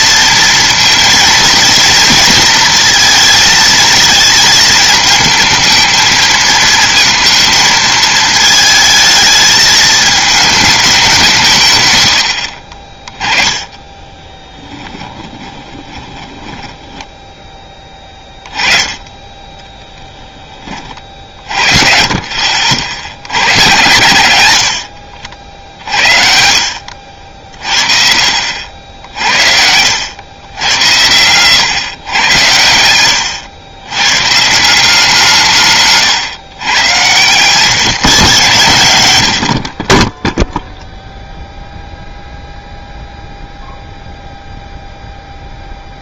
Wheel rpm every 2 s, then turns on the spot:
230, 230, 220, 230, 220, 210, 60, 10, 10, 20, 20, 50, 110, 60, 70, 90, 100, 170, 120, 120, 0, 0, 0.
12-18 26-28